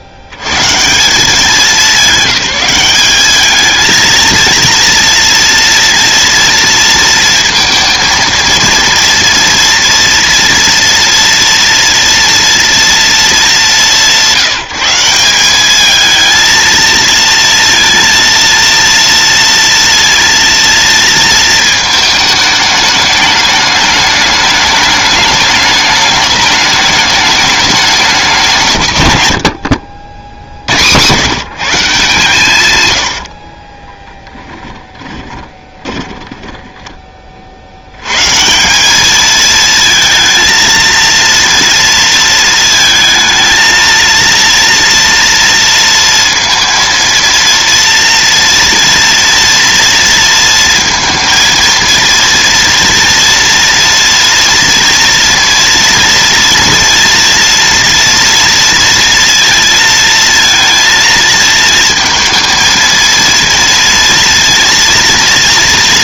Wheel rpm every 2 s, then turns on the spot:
50, 200, 230, 230, 230, 240, 230, 160, 230, 230, 230, 210, 210, 210, 160, 90, 140, 10, 10, 160, 230, 220, 230, 230, 230, 230, 230, 230, 230, 230, 230, 230, 230.
34-38